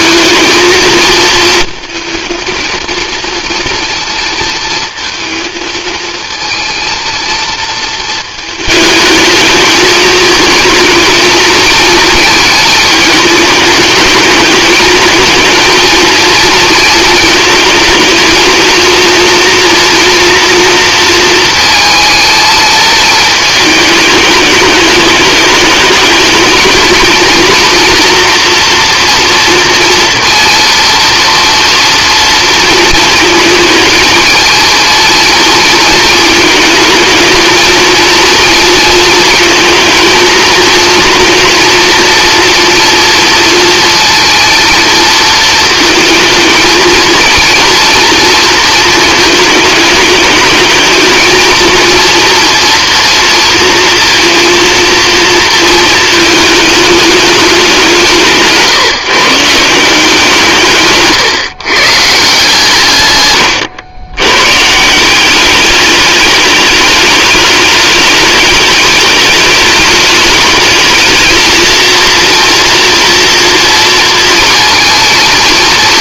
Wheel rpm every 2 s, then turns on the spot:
220, 230, 230, 230, 220, 220, 220, 220, 220, 230, 230, 220, 210, 220, 230, 230, 230, 230, 220, 230, 230, 230, 230, 220, 220, 220, 230, 230, 210, 150, 140, 140, 150, 210, 210, 220, 230, 230.
none